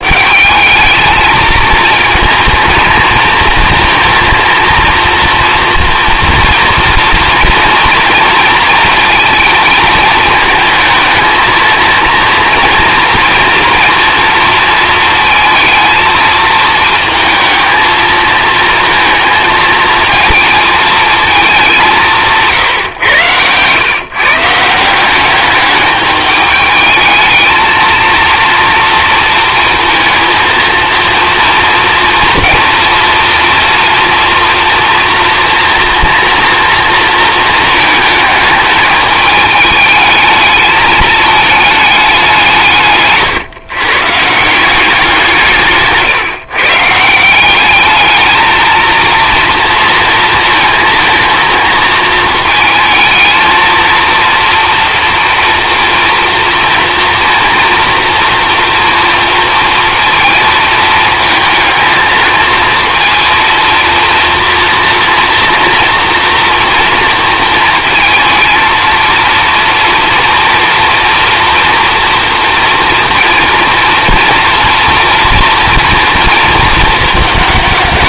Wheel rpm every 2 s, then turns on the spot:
210, 220, 230, 230, 230, 220, 230, 230, 230, 230, 220, 120, 170, 220, 230, 230, 230, 230, 230, 210, 220, 140, 170, 150, 230, 220, 220, 230, 230, 240, 220, 230, 230, 230, 230, 240, 230, 230, 220.
none